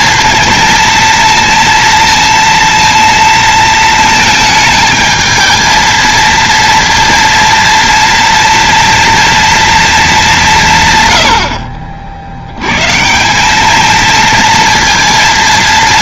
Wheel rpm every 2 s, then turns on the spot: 230, 230, 220, 230, 230, 190, 100, 230.
none